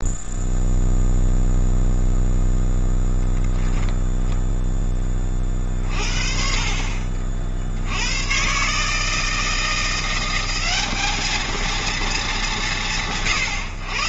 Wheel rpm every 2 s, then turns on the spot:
0, 0, 10, 50, 150, 200, 180.
none